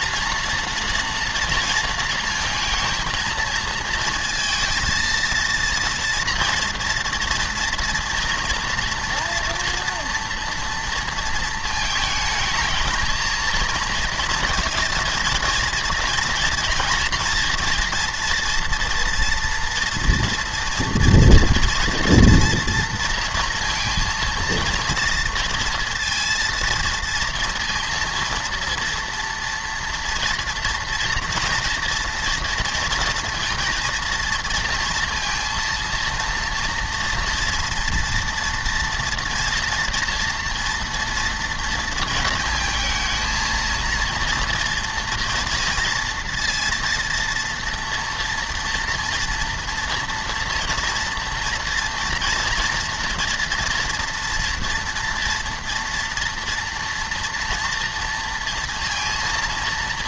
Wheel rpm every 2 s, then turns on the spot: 240, 230, 230, 230, 240, 230, 220, 230, 240, 230, 230, 230, 230, 230, 230, 230, 230, 230, 230, 230, 230, 220, 230, 230, 230, 230, 230, 230, 230, 230.
none